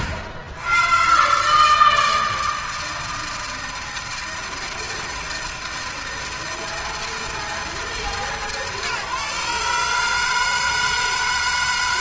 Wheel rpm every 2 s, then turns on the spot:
90, 160, 160, 160, 150, 160.
none